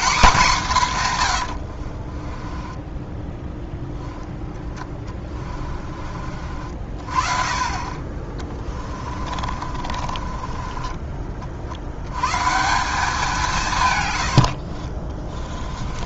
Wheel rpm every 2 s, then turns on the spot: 160, 10, 20, 40, 30, 30, 180, 50.
2-6 8-12 14-16